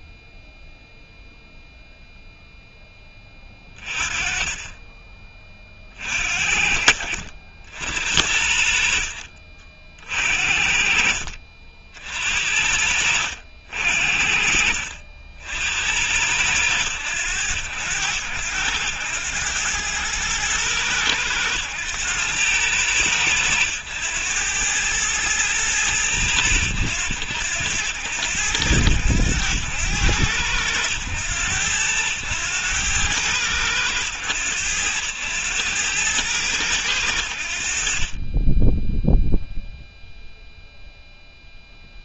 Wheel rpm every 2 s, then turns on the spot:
0, 0, 20, 60, 60, 50, 60, 50, 90, 90, 110, 100, 100, 90, 90, 90, 100, 90, 100, 10, 0.
none